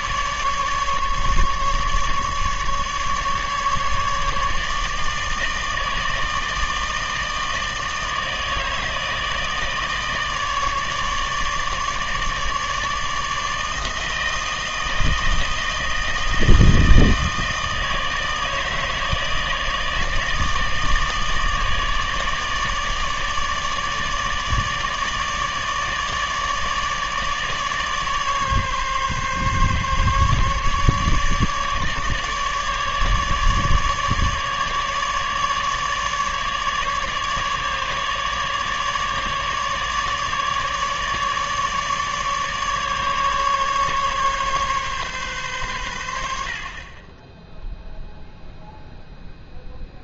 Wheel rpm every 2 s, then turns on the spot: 150, 150, 150, 160, 160, 150, 150, 160, 160, 160, 160, 150, 150, 150, 140, 150, 150, 150, 150, 150, 150, 150, 140, 50, 0.
none